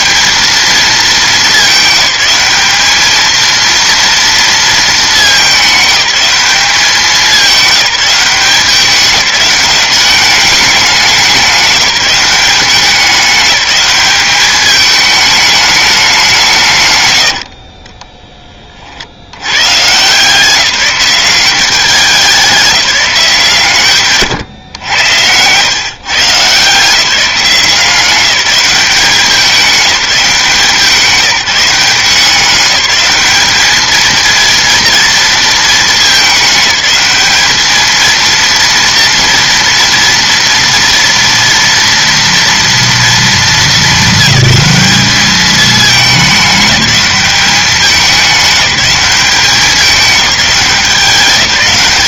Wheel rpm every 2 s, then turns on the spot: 220, 210, 220, 190, 190, 200, 190, 210, 140, 30, 180, 190, 110, 160, 200, 180, 200, 230, 210, 230, 230, 230, 200, 200, 200, 190.
none